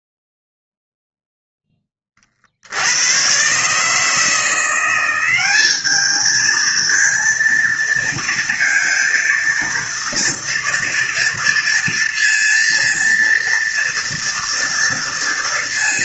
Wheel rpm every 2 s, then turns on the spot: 0, 70, 170, 230, 230, 230, 230, 230.
none